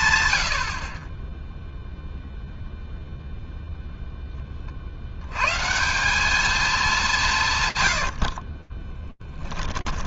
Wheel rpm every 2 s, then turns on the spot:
110, 0, 80, 170, 10.
8-10